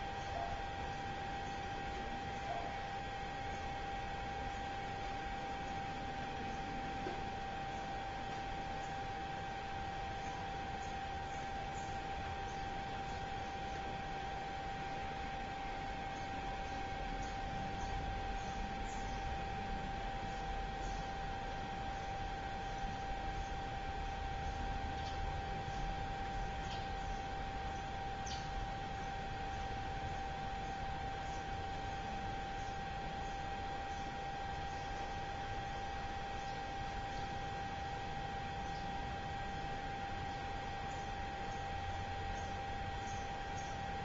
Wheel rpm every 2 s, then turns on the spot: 0, 0, 0, 0, 0, 0, 0, 0, 0, 0, 0, 0, 0, 0, 0, 0, 0, 0, 0, 0, 0, 0.
none